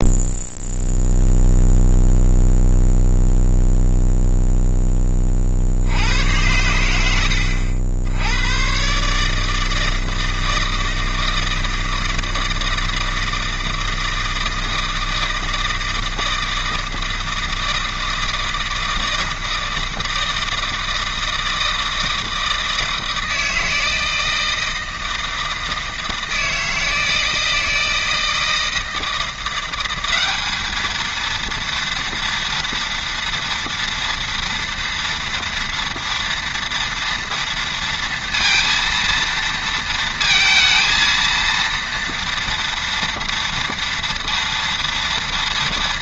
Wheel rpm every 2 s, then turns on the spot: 0, 0, 0, 100, 110, 160, 160, 160, 160, 160, 160, 160, 160, 160, 160, 210, 230, 230, 230, 230, 220, 230, 230.
none